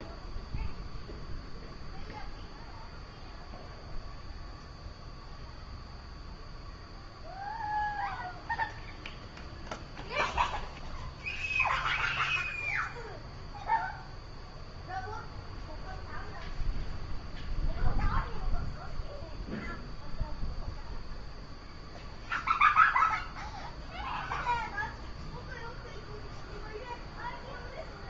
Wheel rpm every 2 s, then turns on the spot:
0, 0, 0, 0, 0, 0, 0, 0, 0, 0, 0, 0, 0, 0.
none